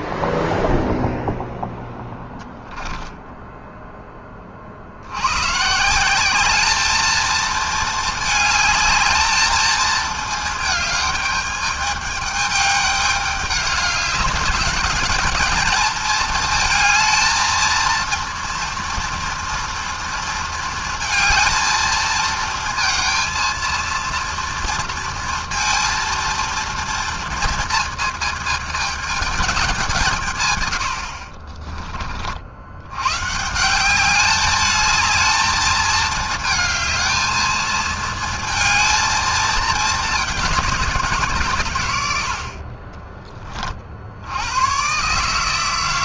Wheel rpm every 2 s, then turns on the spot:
0, 10, 30, 210, 220, 220, 210, 210, 220, 230, 230, 230, 230, 230, 220, 130, 60, 210, 220, 230, 200, 60, 100.
2-4